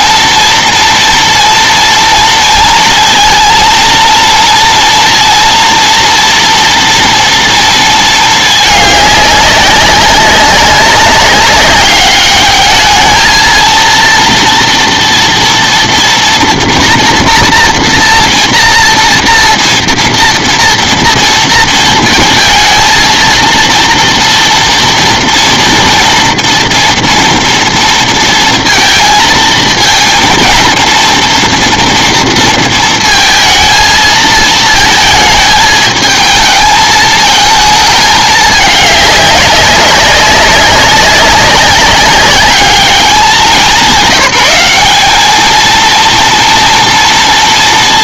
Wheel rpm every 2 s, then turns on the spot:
230, 230, 230, 230, 210, 200, 210, 230, 230, 240, 230, 220, 230, 230, 230, 230, 230, 220, 220, 210, 200, 200, 200, 240.
none